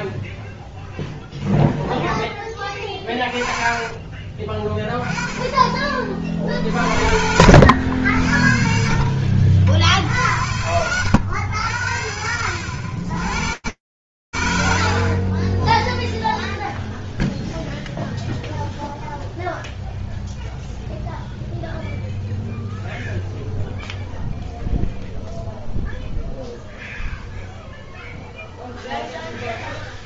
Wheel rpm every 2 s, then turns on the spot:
0, 20, 20, 70, 60, 90, 80, 0, 0, 0, 0, 0, 0, 0, 0.
2-4 6-8